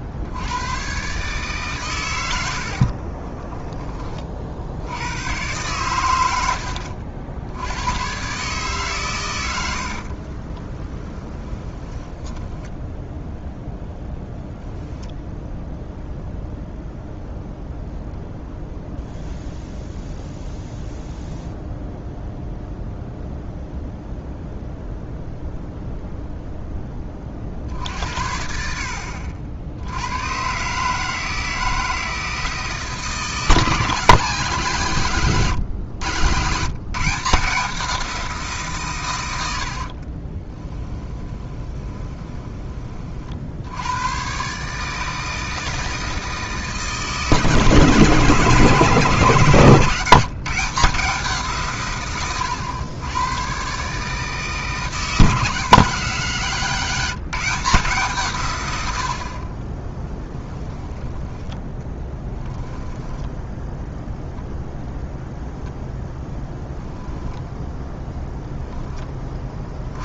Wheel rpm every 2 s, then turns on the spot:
110, 60, 70, 80, 140, 20, 10, 0, 0, 0, 0, 0, 0, 10, 60, 140, 160, 160, 150, 140, 10, 30, 150, 160, 160, 160, 110, 160, 170, 100, 10, 10, 0, 0, 10.
2-4 10-14 40-42 62-64